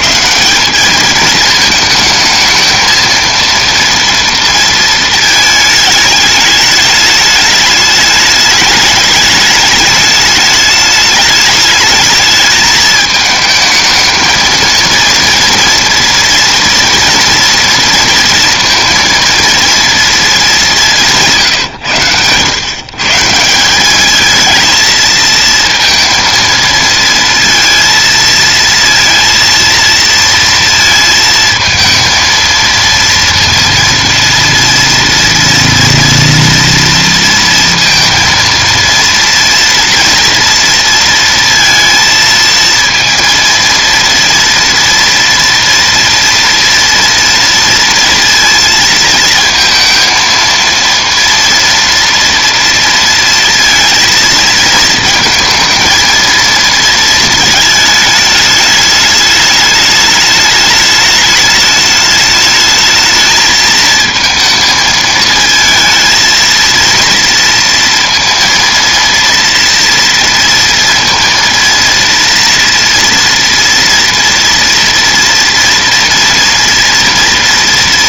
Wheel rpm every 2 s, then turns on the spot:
200, 220, 230, 210, 210, 210, 210, 230, 230, 230, 210, 130, 220, 230, 230, 230, 230, 230, 230, 230, 230, 230, 230, 230, 230, 230, 230, 220, 230, 210, 210, 210, 220, 230, 230, 230, 230, 230, 230.
none